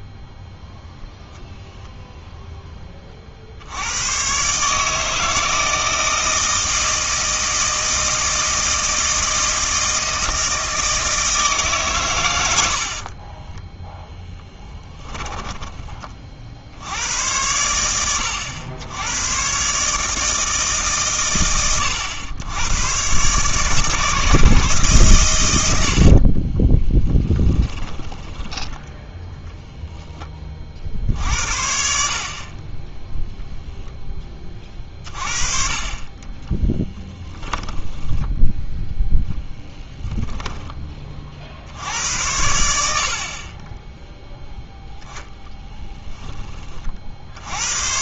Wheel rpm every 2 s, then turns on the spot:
0, 10, 150, 160, 160, 160, 60, 10, 70, 90, 150, 110, 140, 20, 10, 50, 20, 30, 10, 0, 20, 80, 0, 30.
12-16 26-28 36-38